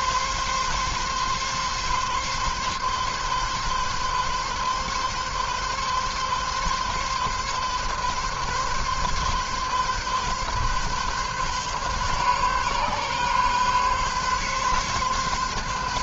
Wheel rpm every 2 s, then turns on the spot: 140, 140, 140, 140, 140, 140, 140, 140.
none